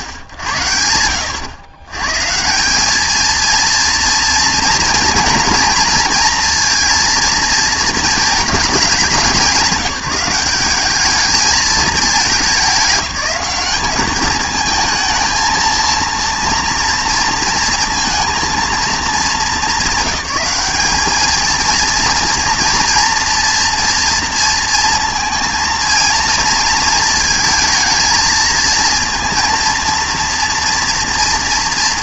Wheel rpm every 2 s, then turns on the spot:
90, 180, 230, 230, 210, 190, 210, 220, 230, 220, 200, 230, 230, 230, 230, 230.
none